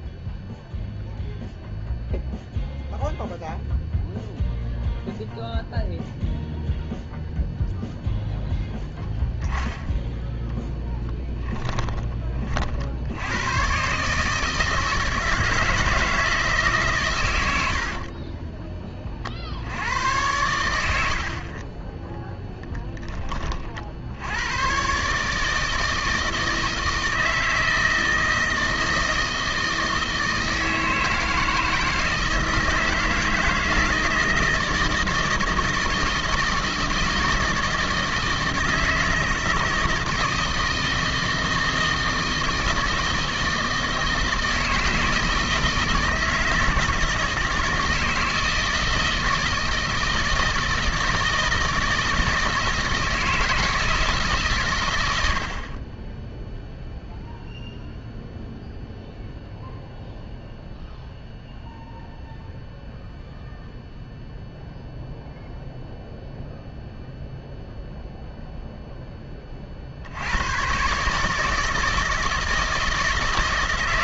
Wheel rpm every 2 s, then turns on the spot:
0, 0, 0, 0, 0, 10, 40, 160, 150, 20, 80, 10, 110, 160, 160, 160, 170, 160, 160, 160, 160, 160, 160, 160, 160, 160, 160, 120, 0, 0, 0, 0, 0, 0, 0, 110, 160.
none